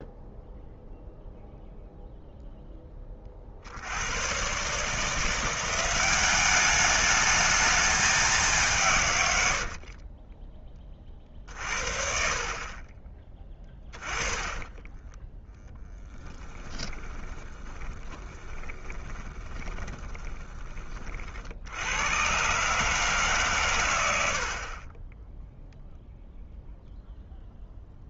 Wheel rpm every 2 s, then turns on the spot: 0, 10, 120, 200, 190, 30, 40, 10, 10, 20, 20, 130, 70, 0.
10-14 16-20